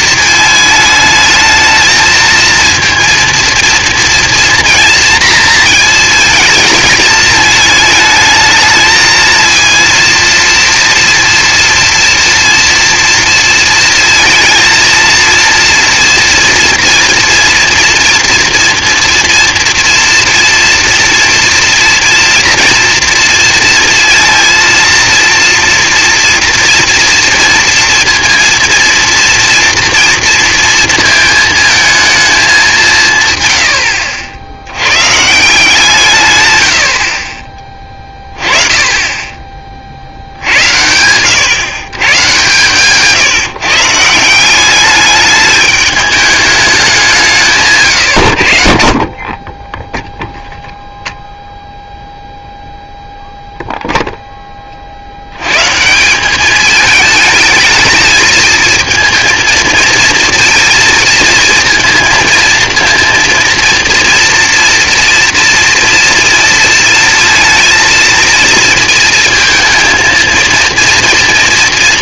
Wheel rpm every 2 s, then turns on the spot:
220, 230, 230, 220, 220, 230, 230, 230, 230, 230, 230, 230, 230, 230, 230, 230, 200, 80, 110, 20, 80, 120, 180, 200, 60, 0, 0, 20, 200, 220, 230, 230, 230, 230, 230, 230.
none